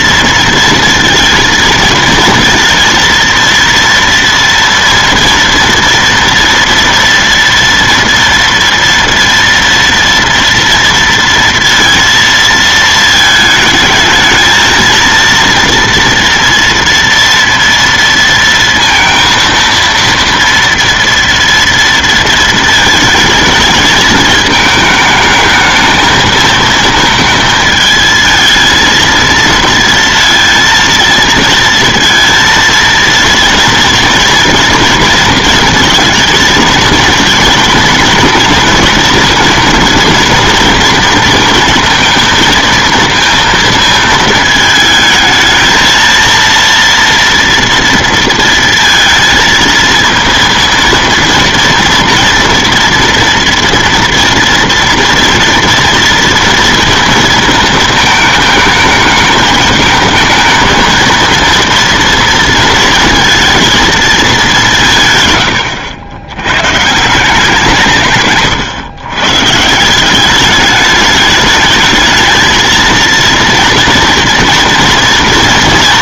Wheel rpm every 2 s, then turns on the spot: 230, 230, 230, 230, 230, 230, 220, 220, 230, 230, 230, 220, 220, 220, 220, 230, 230, 230, 230, 230, 230, 230, 220, 230, 230, 230, 230, 230, 230, 220, 220, 230, 180, 130, 120, 210, 220, 230.
none